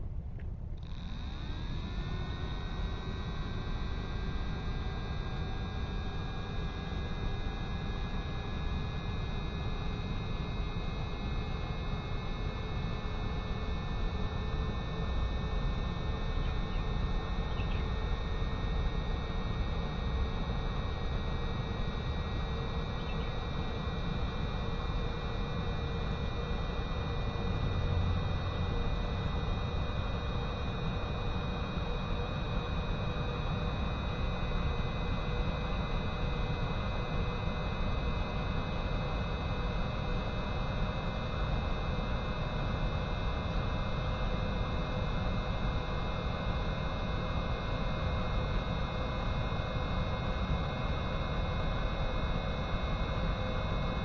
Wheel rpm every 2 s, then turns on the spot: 0, 0, 0, 0, 0, 0, 0, 0, 0, 0, 0, 0, 0, 0, 0, 0, 0, 0, 0, 0, 0, 0, 0, 0, 0, 0, 0.
none